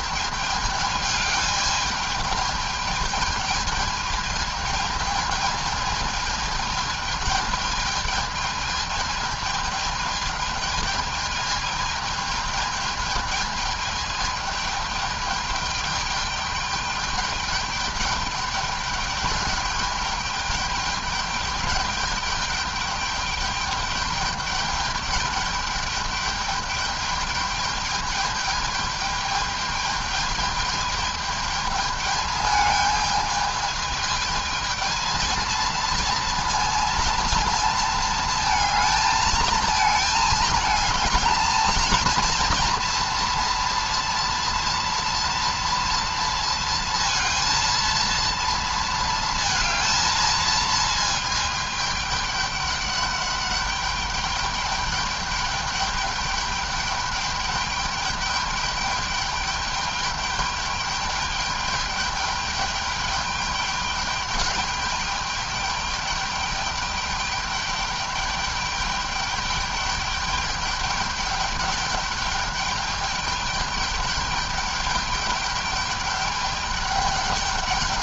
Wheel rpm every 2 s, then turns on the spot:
210, 210, 220, 210, 220, 220, 220, 210, 210, 210, 210, 210, 210, 210, 210, 210, 210, 220, 230, 220, 220, 230, 230, 230, 230, 220, 200, 200, 210, 210, 210, 210, 210, 210, 210, 210, 210, 210, 200.
none